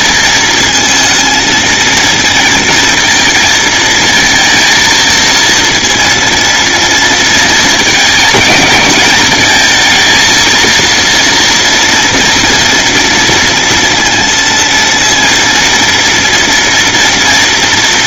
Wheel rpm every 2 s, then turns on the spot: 220, 230, 230, 230, 220, 230, 230, 230, 230.
none